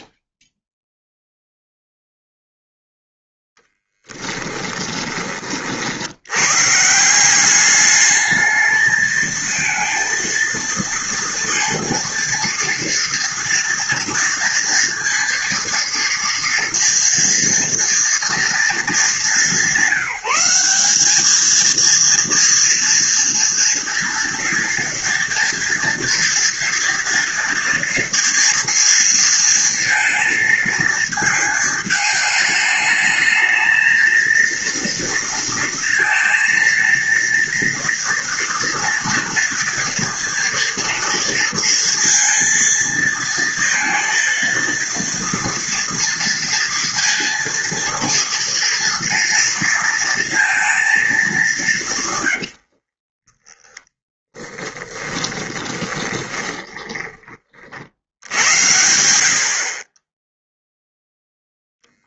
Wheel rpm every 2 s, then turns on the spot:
0, 0, 20, 160, 220, 230, 240, 230, 240, 210, 200, 240, 230, 230, 230, 220, 220, 230, 230, 240, 230, 230, 230, 230, 230, 220, 50, 10, 20, 80, 0.
52-58